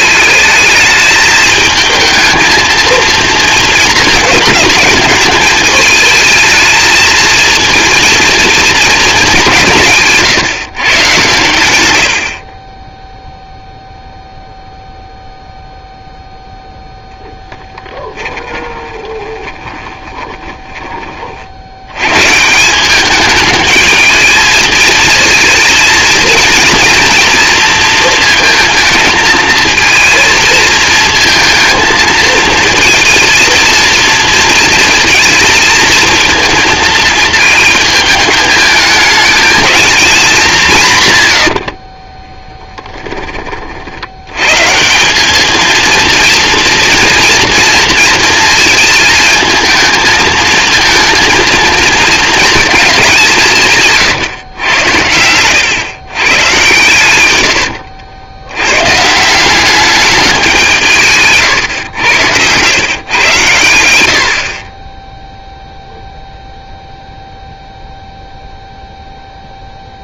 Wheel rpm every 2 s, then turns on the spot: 220, 230, 210, 220, 220, 130, 10, 0, 0, 20, 20, 170, 220, 230, 220, 230, 230, 230, 230, 220, 180, 20, 140, 230, 230, 230, 220, 120, 120, 110, 180, 120, 40, 0, 0.
18-22 40-44